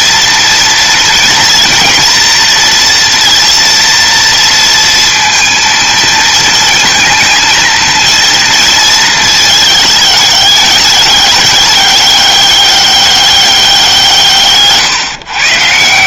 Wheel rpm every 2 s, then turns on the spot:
230, 230, 230, 230, 230, 200, 200, 130.
none